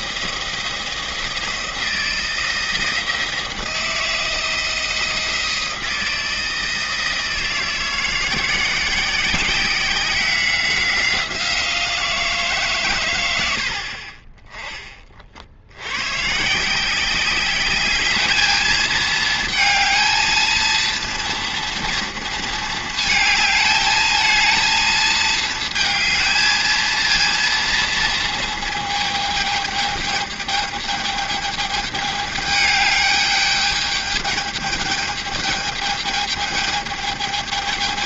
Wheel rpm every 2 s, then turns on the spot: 160, 160, 160, 160, 170, 180, 150, 20, 170, 220, 230, 220, 220, 220, 220, 210, 210, 210, 210.
none